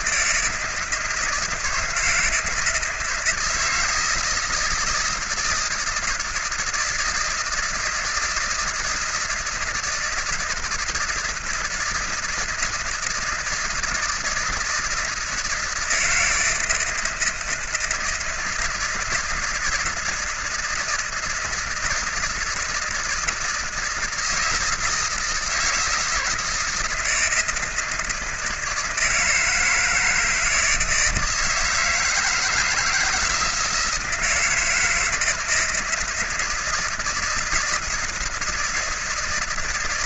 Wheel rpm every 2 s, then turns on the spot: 160, 160, 160, 160, 160, 170, 160, 160, 160, 160, 170, 170, 160, 160, 160, 160, 160, 170, 160, 160.
none